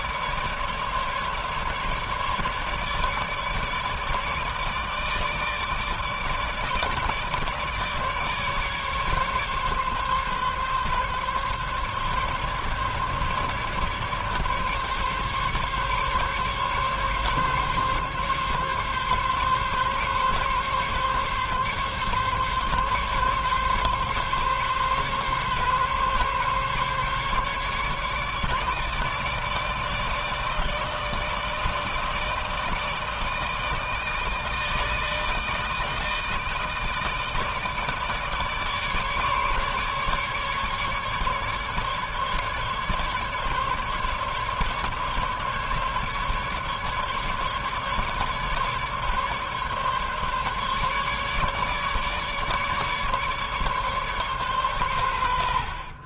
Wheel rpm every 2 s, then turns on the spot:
150, 150, 150, 150, 140, 140, 150, 150, 140, 140, 140, 140, 140, 140, 150, 160, 160, 160, 160, 150, 150, 140, 140, 150, 150, 150, 150, 90.
none